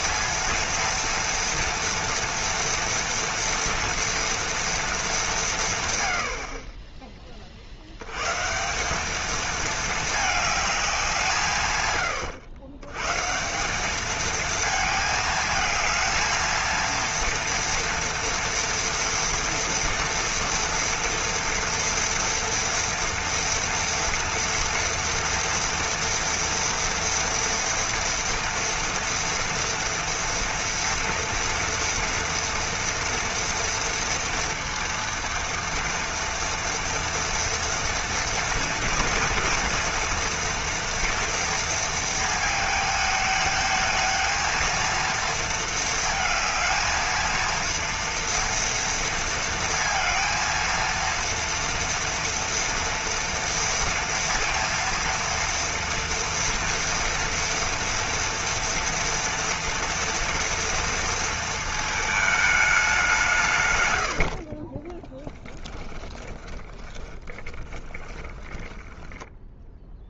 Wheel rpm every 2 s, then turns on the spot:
230, 230, 230, 30, 190, 200, 120, 220, 230, 240, 230, 230, 240, 230, 230, 230, 230, 230, 230, 230, 240, 220, 230, 220, 230, 230, 230, 230, 230, 230, 230, 200, 10, 20, 10.
64-70